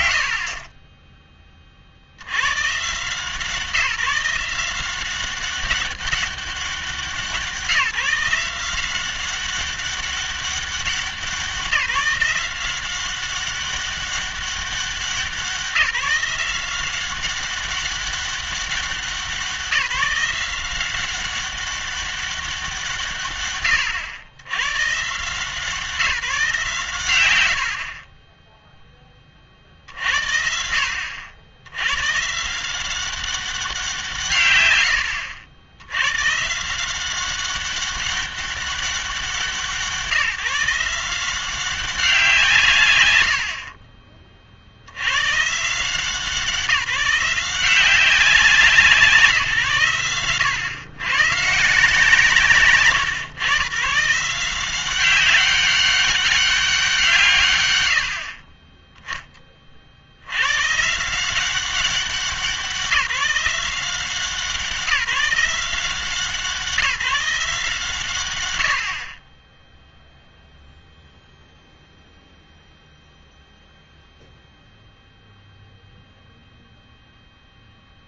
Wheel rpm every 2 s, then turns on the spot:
50, 140, 180, 190, 180, 190, 190, 190, 180, 190, 180, 170, 110, 140, 10, 60, 170, 90, 170, 190, 170, 150, 70, 170, 170, 110, 150, 180, 180, 20, 140, 180, 180, 160, 80, 0, 0, 0, 0.
0-2 52-54